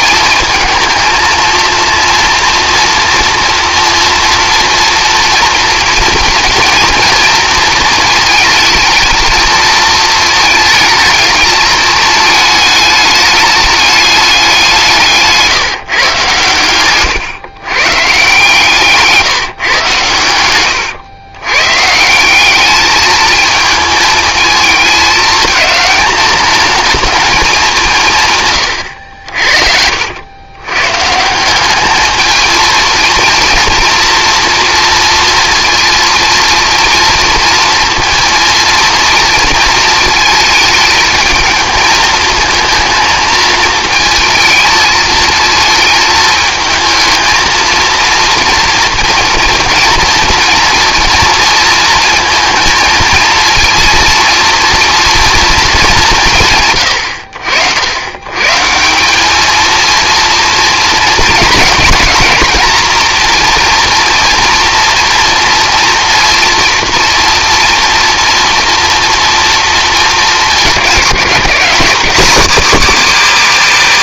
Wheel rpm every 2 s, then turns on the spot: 230, 230, 230, 230, 220, 220, 210, 190, 120, 150, 110, 200, 220, 210, 130, 110, 220, 230, 230, 230, 220, 220, 220, 220, 230, 240, 230, 230, 90, 140, 230, 230, 240, 230, 230, 200, 200.
20-22